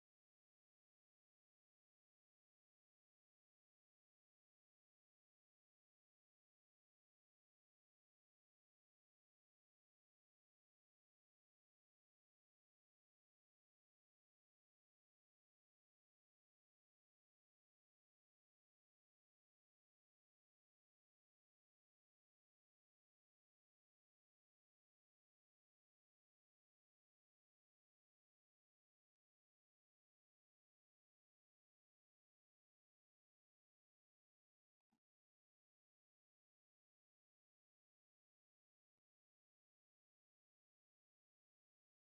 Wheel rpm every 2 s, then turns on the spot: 0, 0, 0, 0, 0, 0, 0, 0, 0, 0, 0, 0, 0, 0, 0, 0, 0, 0, 0, 0, 0.
none